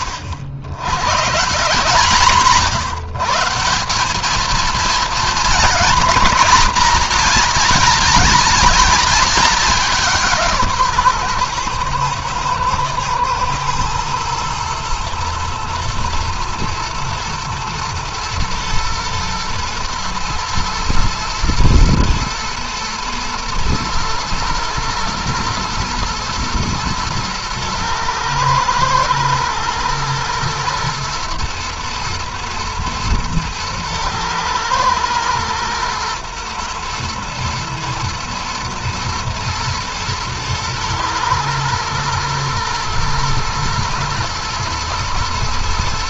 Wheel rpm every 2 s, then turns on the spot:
90, 150, 220, 220, 230, 160, 110, 120, 110, 110, 110, 120, 110, 110, 110, 120, 110, 110, 110, 110, 110, 120, 120.
none